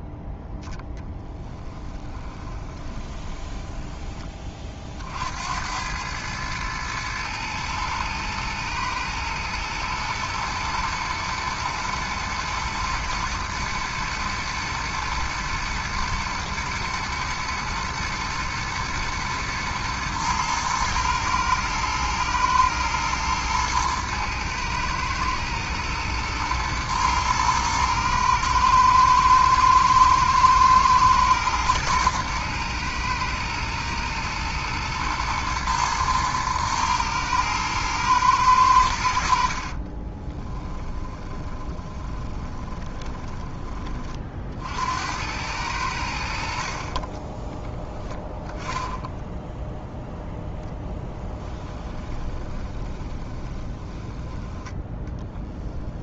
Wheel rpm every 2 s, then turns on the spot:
0, 20, 40, 110, 110, 110, 120, 110, 110, 110, 110, 110, 110, 120, 110, 110, 120, 110, 110, 80, 20, 20, 70, 30, 10, 10, 20, 20.
2-4 40-44 50-54